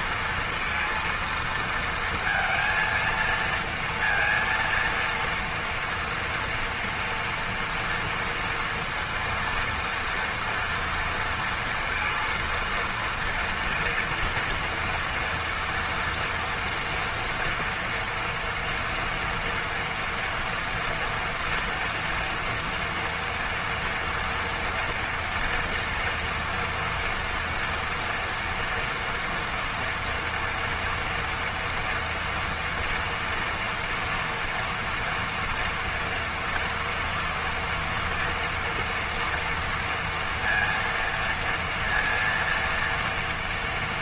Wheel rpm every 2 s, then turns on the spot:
230, 230, 230, 240, 230, 230, 230, 230, 230, 230, 230, 230, 230, 230, 240, 230, 230, 230, 240, 240, 230, 230.
none